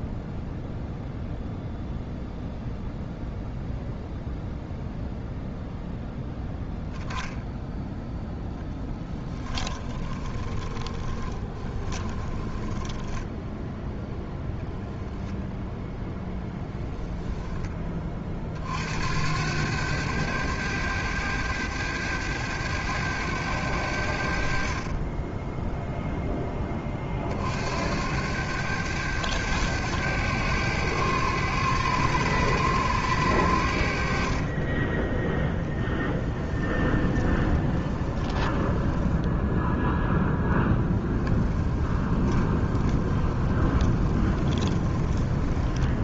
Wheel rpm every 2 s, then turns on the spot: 0, 0, 0, 0, 10, 30, 10, 0, 0, 70, 100, 100, 30, 30, 100, 100, 100, 20, 20, 10, 10, 20, 20.
8-12 36-46